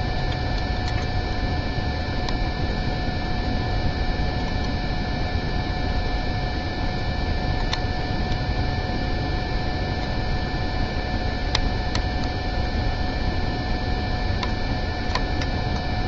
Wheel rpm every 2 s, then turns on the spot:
0, 0, 0, 0, 0, 0, 0, 0.
none